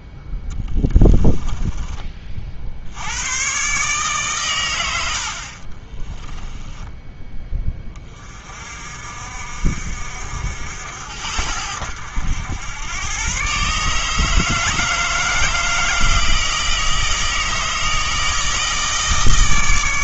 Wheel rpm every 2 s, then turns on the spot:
10, 60, 110, 20, 40, 70, 100, 160, 160, 160.
0-2 6-8